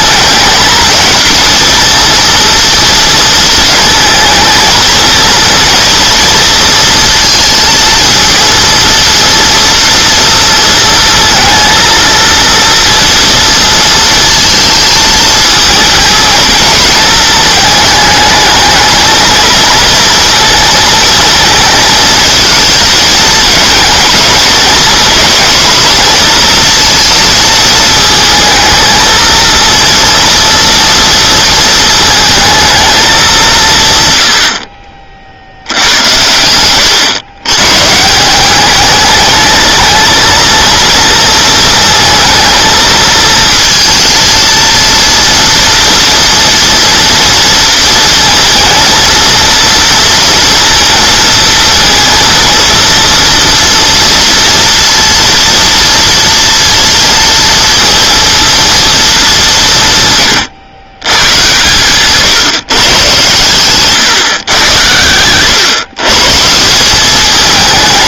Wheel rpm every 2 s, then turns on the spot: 220, 230, 230, 230, 230, 230, 230, 220, 220, 220, 230, 220, 230, 230, 220, 230, 220, 50, 110, 200, 230, 220, 230, 230, 230, 230, 230, 230, 230, 230, 120, 150, 110, 170.
none